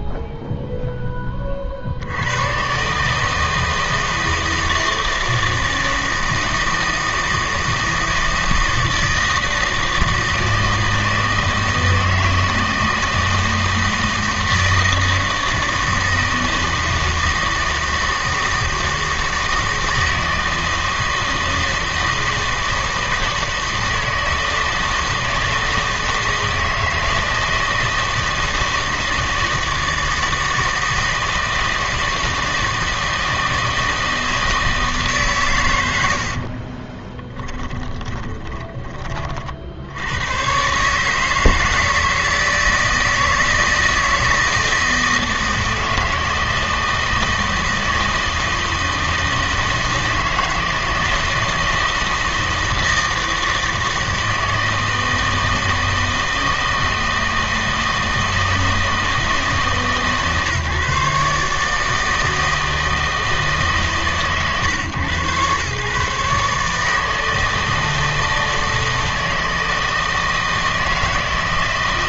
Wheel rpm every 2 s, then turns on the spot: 10, 140, 160, 160, 160, 160, 160, 160, 160, 160, 160, 160, 160, 160, 160, 160, 160, 160, 30, 20, 130, 160, 160, 160, 160, 160, 160, 160, 160, 160, 150, 160, 130, 150, 160, 160.
36-40